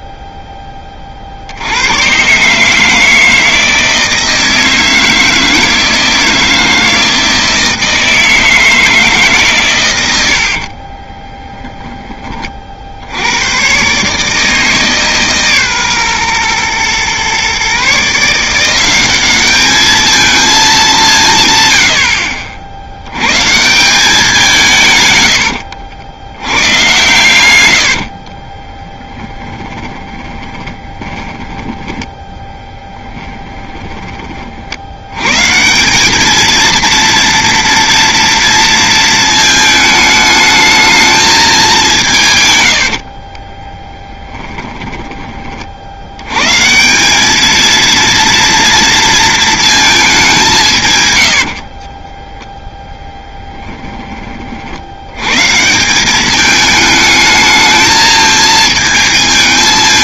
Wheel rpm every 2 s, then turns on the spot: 30, 150, 160, 160, 160, 50, 50, 150, 120, 180, 210, 70, 160, 110, 20, 20, 10, 50, 220, 230, 220, 90, 10, 150, 230, 160, 10, 70, 210, 220.
10-12 28-34 42-46